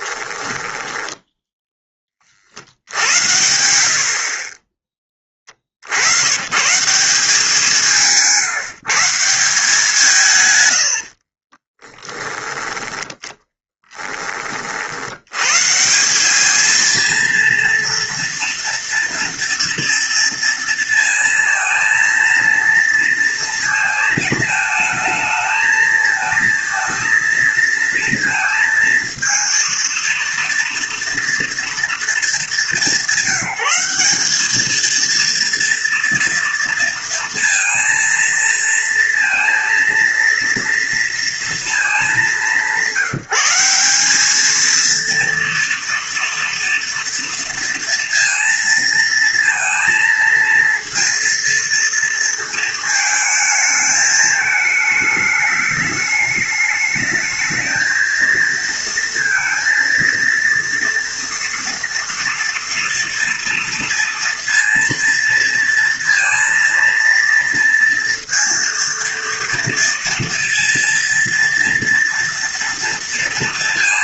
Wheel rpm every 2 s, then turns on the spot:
10, 60, 20, 150, 160, 110, 10, 60, 220, 230, 230, 230, 220, 220, 230, 230, 190, 220, 230, 230, 230, 180, 230, 230, 230, 230, 220, 220, 210, 230, 230, 230, 230, 230, 230, 230, 230.
0-2 4-6 12-14